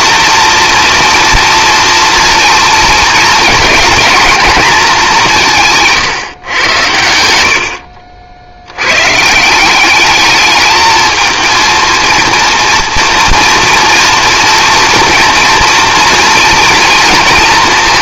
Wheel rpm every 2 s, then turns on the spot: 230, 230, 230, 110, 100, 220, 230, 230, 230.
none